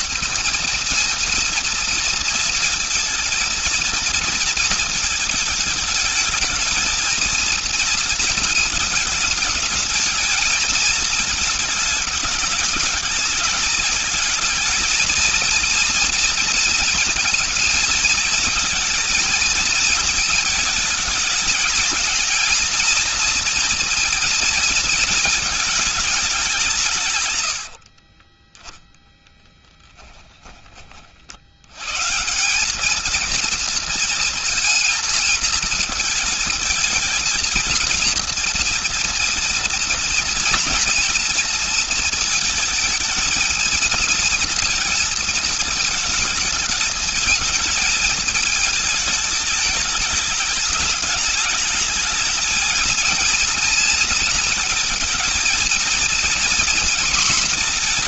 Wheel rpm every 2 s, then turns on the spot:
230, 230, 230, 220, 220, 220, 210, 220, 230, 230, 220, 230, 230, 170, 20, 30, 210, 230, 220, 230, 230, 220, 230, 220, 220, 200, 220, 230, 240.
28-30